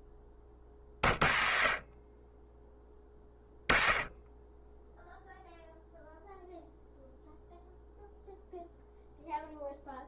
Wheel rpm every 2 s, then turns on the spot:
30, 20, 0, 0, 0.
none